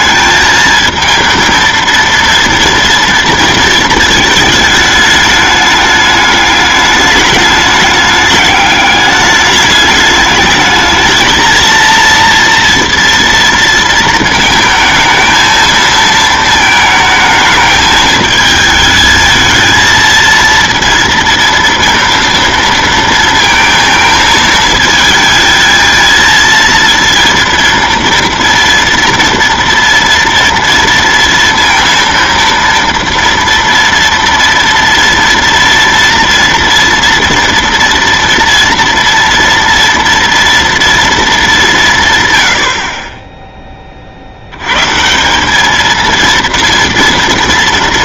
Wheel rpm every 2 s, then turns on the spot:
220, 230, 210, 210, 210, 210, 230, 220, 220, 220, 230, 230, 220, 230, 230, 230, 230, 230, 230, 230, 230, 80, 110, 230.
none